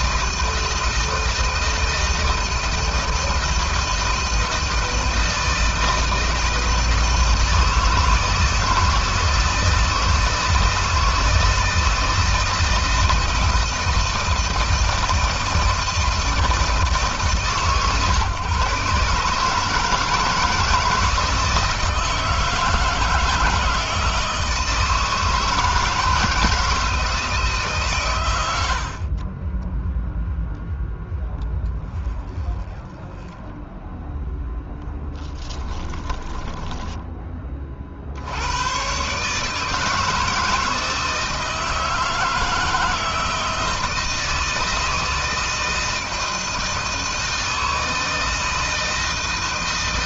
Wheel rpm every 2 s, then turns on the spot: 160, 160, 160, 160, 160, 160, 170, 160, 160, 140, 160, 160, 160, 160, 80, 0, 10, 0, 10, 110, 160, 160, 160, 160, 160.
32-34